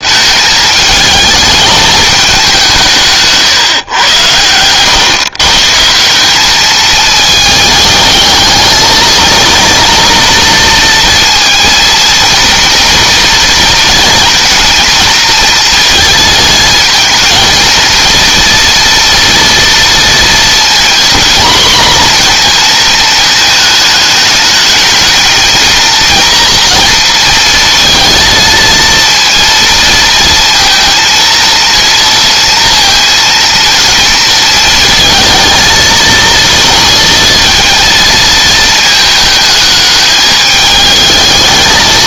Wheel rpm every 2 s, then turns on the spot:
220, 170, 120, 220, 220, 230, 230, 230, 220, 230, 240, 230, 210, 230, 230, 230, 230, 230, 230, 220, 220.
none